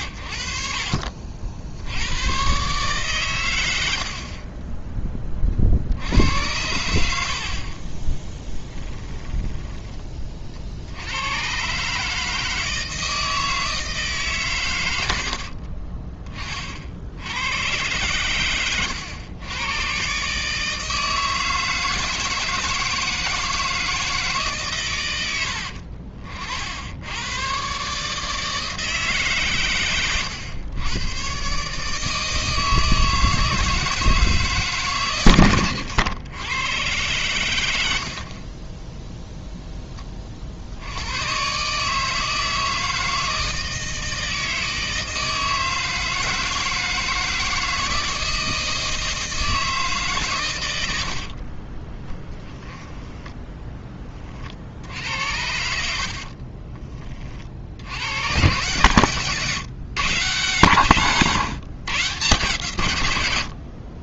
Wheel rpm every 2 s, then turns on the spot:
60, 120, 30, 90, 20, 60, 160, 130, 40, 110, 160, 160, 140, 60, 160, 100, 160, 150, 110, 30, 60, 160, 160, 160, 160, 110, 20, 50, 40, 120, 140, 130.
8-10 52-54 56-58